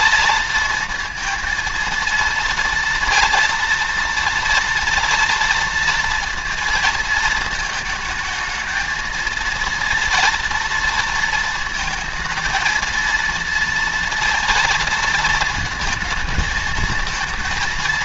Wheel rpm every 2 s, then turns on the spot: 230, 230, 230, 230, 220, 230, 230, 230, 220.
none